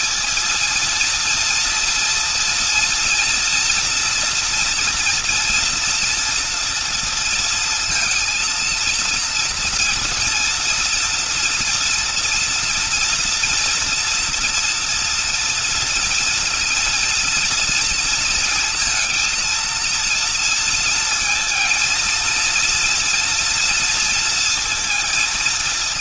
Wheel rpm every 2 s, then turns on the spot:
210, 230, 230, 230, 230, 230, 230, 230, 230, 230, 230, 230, 230.
none